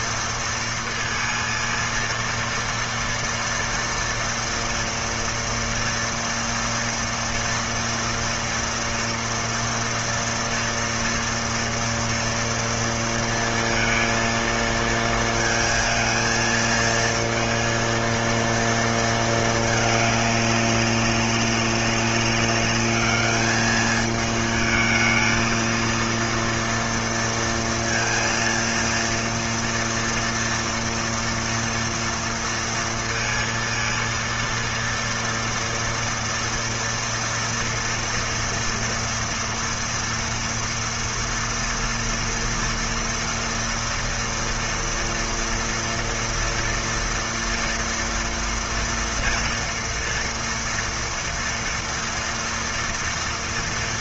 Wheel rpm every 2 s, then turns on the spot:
230, 230, 230, 230, 230, 230, 240, 230, 220, 230, 200, 200, 220, 230, 230, 230, 230, 230, 230, 230, 230, 230, 230, 230, 230, 230, 230.
none